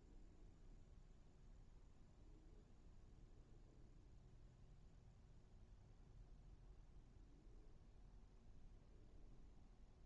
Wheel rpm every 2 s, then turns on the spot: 0, 0, 0, 0, 0.
none